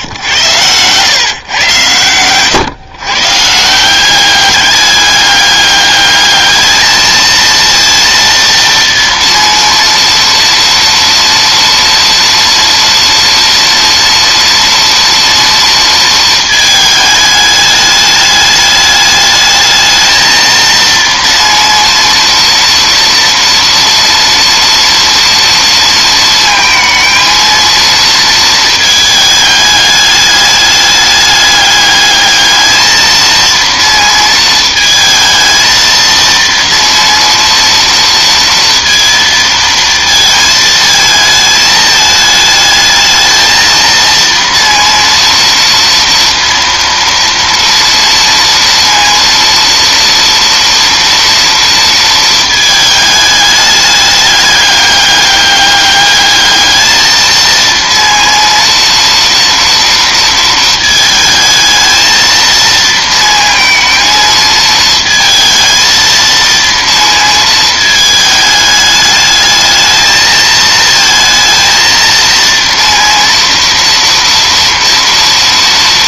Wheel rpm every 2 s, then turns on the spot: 100, 130, 200, 220, 230, 230, 230, 230, 220, 210, 230, 230, 230, 220, 220, 210, 220, 220, 230, 230, 220, 220, 230, 230, 230, 230, 220, 200, 220, 230, 220, 230, 220, 230, 210, 220, 230, 230.
none